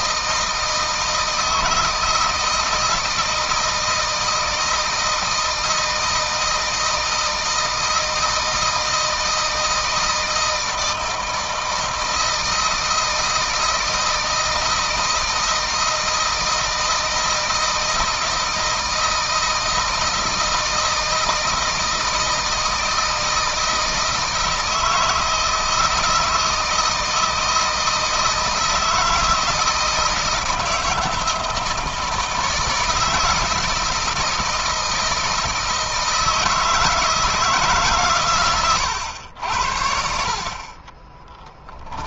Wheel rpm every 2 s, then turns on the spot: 160, 160, 160, 160, 160, 160, 160, 160, 160, 160, 160, 160, 160, 160, 160, 160, 160, 160, 160, 110, 30.
40-42